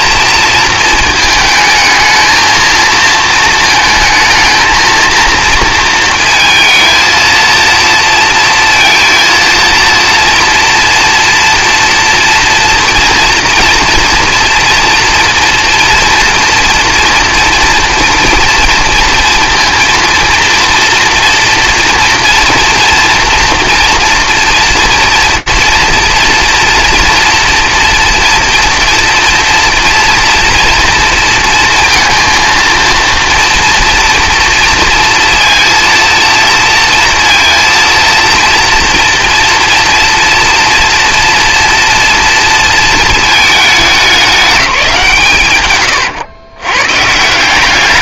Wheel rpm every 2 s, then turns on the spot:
230, 220, 220, 220, 230, 230, 230, 240, 240, 230, 230, 230, 230, 230, 230, 240, 230, 230, 230, 240, 240, 230, 200, 130.
none